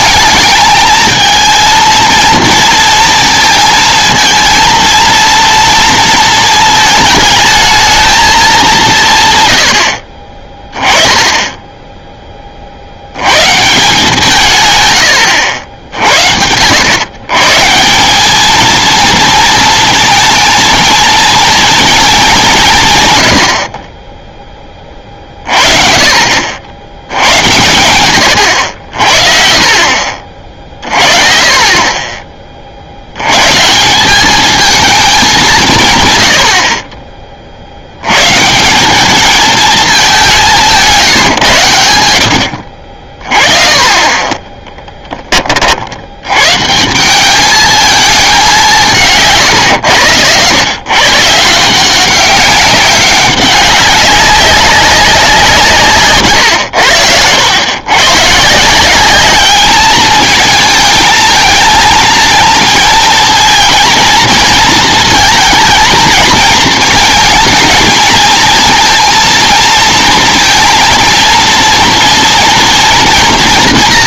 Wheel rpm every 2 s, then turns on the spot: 210, 230, 230, 220, 190, 20, 50, 130, 80, 220, 230, 170, 20, 70, 70, 40, 40, 220, 50, 170, 170, 60, 10, 150, 170, 120, 190, 190, 100, 170, 220, 230, 220, 220, 230, 230, 230.
none